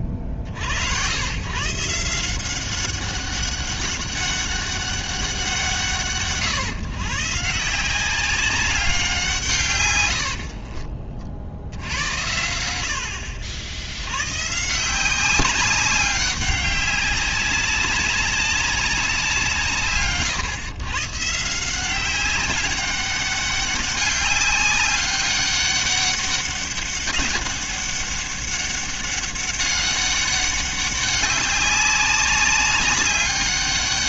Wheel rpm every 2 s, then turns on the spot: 70, 190, 200, 130, 190, 40, 80, 170, 200, 200, 130, 190, 190, 200, 200, 200, 200.
10-12